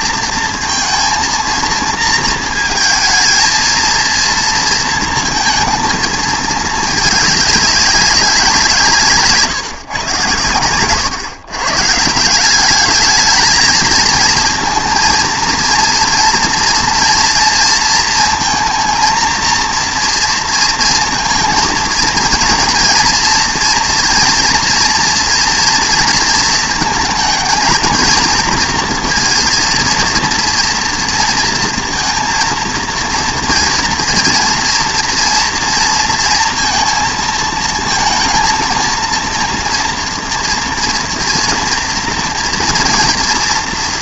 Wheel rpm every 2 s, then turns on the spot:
230, 230, 230, 220, 170, 130, 210, 230, 240, 230, 230, 230, 230, 220, 230, 240, 230, 230, 230, 230, 230, 230.
none